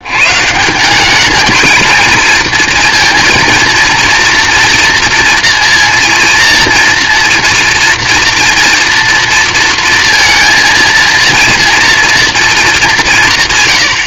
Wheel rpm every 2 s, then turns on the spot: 160, 230, 230, 230, 230, 230, 210.
none